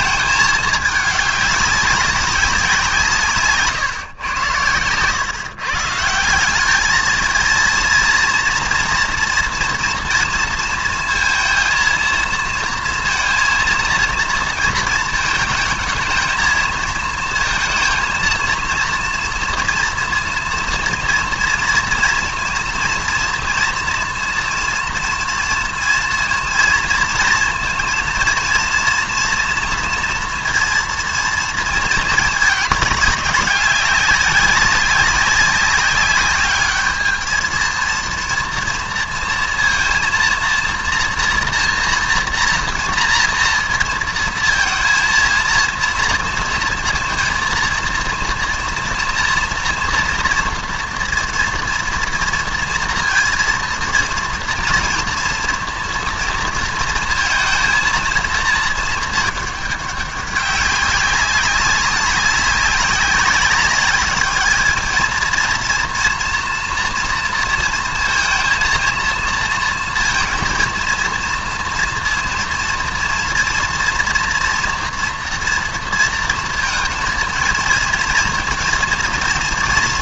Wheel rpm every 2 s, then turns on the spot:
210, 180, 110, 200, 230, 230, 230, 230, 220, 230, 240, 230, 230, 230, 230, 230, 210, 200, 210, 230, 230, 230, 230, 230, 230, 230, 230, 230, 230, 220, 200, 200, 210, 230, 230, 230, 230, 240, 230, 230.
none